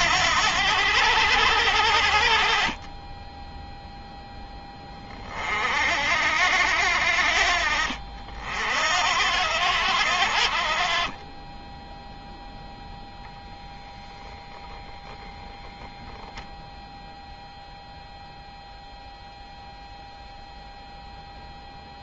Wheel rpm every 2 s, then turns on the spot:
90, 20, 30, 60, 70, 30, 0, 0, 0, 0, 0.
none